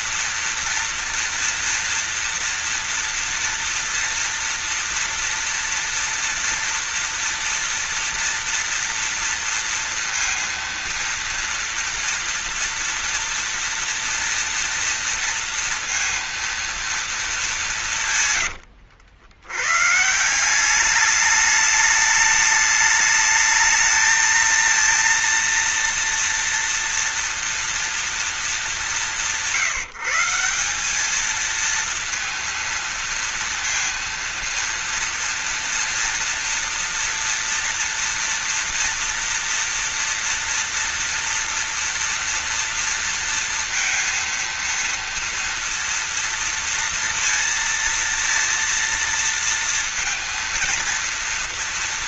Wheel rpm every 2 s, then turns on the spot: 230, 230, 230, 230, 230, 230, 230, 230, 240, 120, 180, 210, 230, 230, 180, 180, 230, 230, 230, 230, 230, 230, 230, 230, 230, 230.
18-20